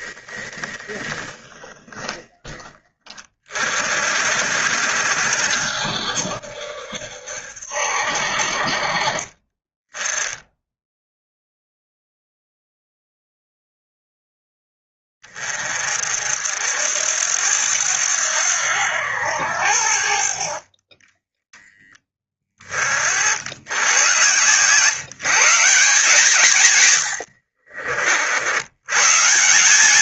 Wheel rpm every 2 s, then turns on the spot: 20, 20, 60, 70, 40, 10, 0, 10, 70, 90, 40, 40, 130, 110, 110.
0-2